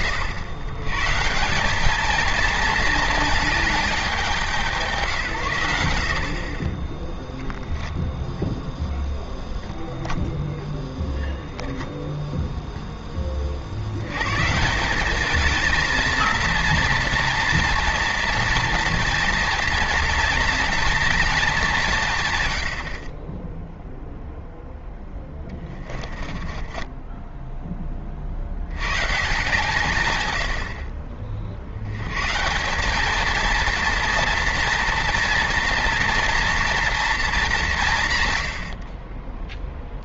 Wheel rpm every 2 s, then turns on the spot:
130, 230, 160, 20, 0, 0, 0, 180, 230, 230, 230, 70, 0, 10, 100, 70, 190, 230, 230, 60.
26-28